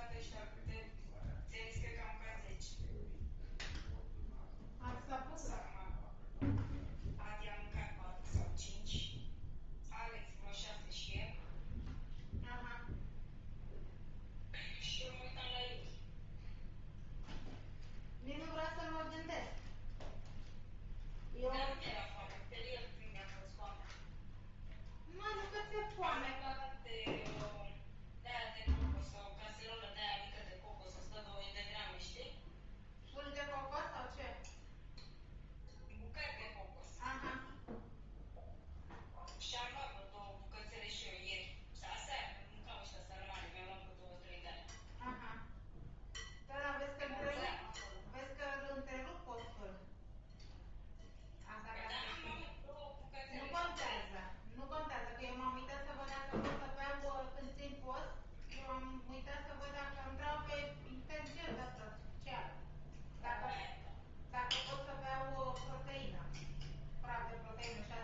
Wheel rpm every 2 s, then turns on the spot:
0, 0, 0, 0, 0, 0, 0, 0, 0, 0, 0, 0, 0, 0, 0, 0, 0, 0, 0, 0, 0, 0, 0, 0, 0, 0, 0, 0, 0, 0, 0, 0, 0, 0.
none